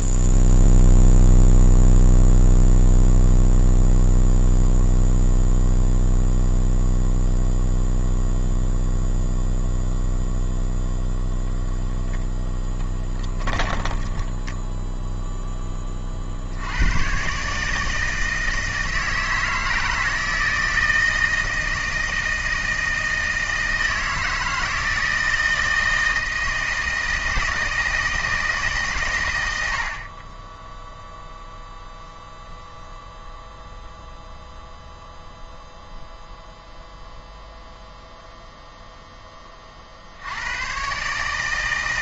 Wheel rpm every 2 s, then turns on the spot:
0, 0, 0, 0, 0, 0, 10, 0, 100, 160, 160, 160, 160, 160, 140, 10, 0, 0, 0, 0, 110.
12-14